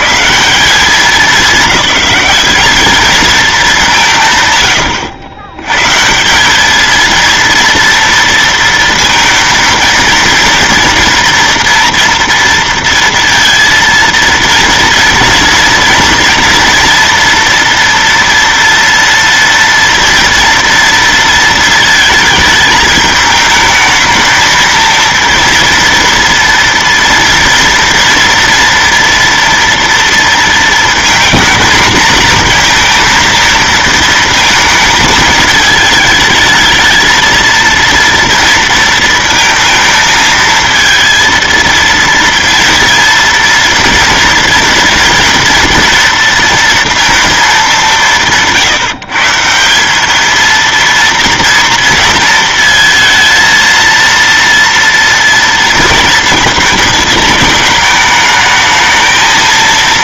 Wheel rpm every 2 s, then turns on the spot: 140, 210, 120, 210, 230, 230, 230, 230, 230, 230, 230, 220, 230, 230, 230, 230, 230, 220, 220, 230, 230, 230, 230, 230, 170, 230, 220, 230, 220, 220.
none